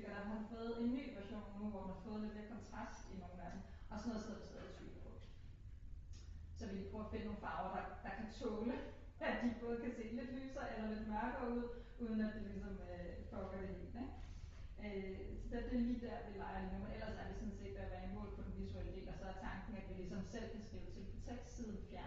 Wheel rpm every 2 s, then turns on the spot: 0, 0, 0, 0, 0, 0, 0, 0, 0, 0, 0.
none